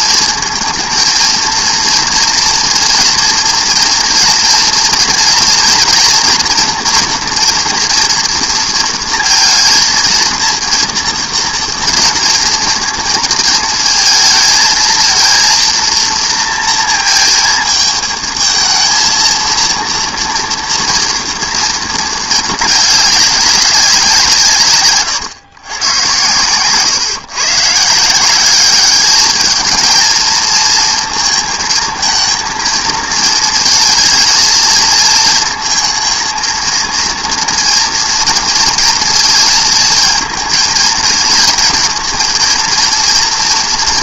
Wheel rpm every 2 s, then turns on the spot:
230, 230, 230, 230, 230, 230, 230, 220, 230, 230, 230, 210, 150, 120, 200, 230, 230, 220, 230, 230, 230, 230.
none